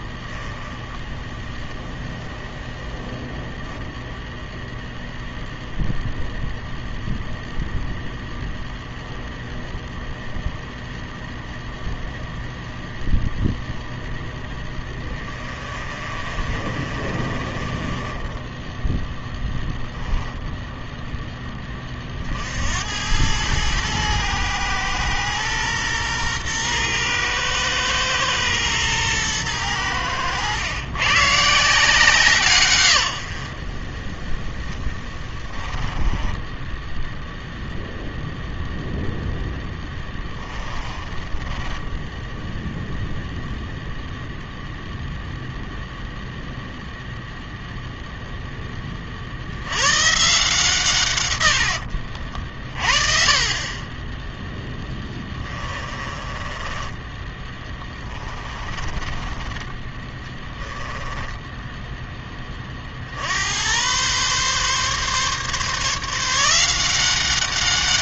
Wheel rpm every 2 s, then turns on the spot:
10, 0, 0, 0, 0, 0, 0, 10, 40, 10, 0, 70, 120, 120, 110, 100, 140, 10, 10, 0, 20, 0, 0, 0, 10, 160, 50, 10, 20, 20, 10, 30, 130, 170.
0-2 14-20 36-38 40-42 54-62